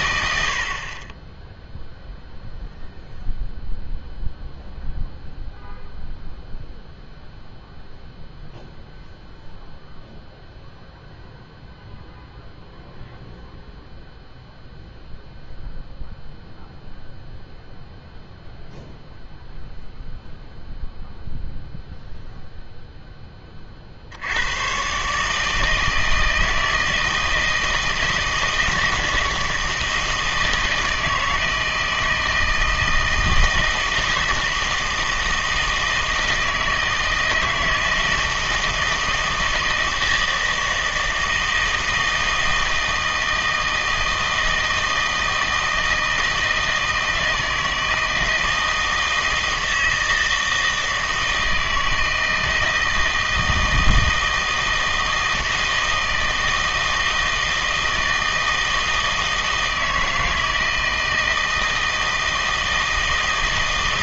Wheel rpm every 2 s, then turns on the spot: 70, 0, 0, 0, 0, 0, 0, 0, 0, 0, 0, 0, 110, 160, 160, 160, 160, 160, 160, 160, 160, 160, 160, 160, 160, 160, 160, 160, 160, 160, 160, 160.
none